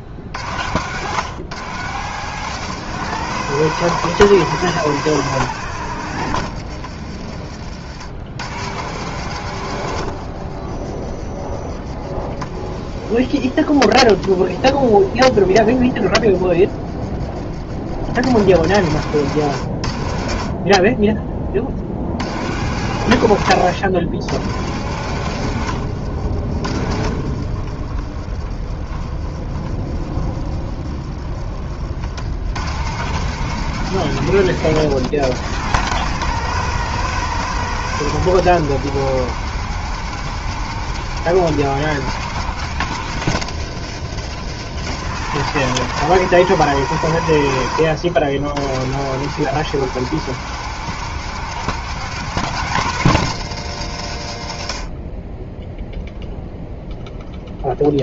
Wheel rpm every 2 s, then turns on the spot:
50, 120, 120, 70, 90, 40, 40, 30, 30, 80, 30, 90, 90, 60, 40, 40, 90, 110, 120, 120, 130, 120, 100, 120, 100, 130, 150, 70, 0.
10-16 26-32